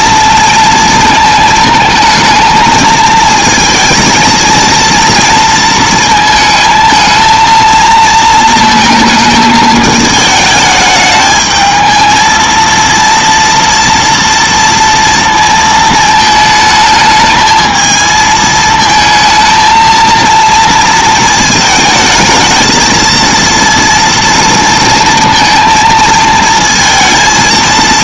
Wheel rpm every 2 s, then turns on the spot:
230, 220, 230, 220, 220, 220, 230, 230, 220, 220, 230, 220, 230, 230.
none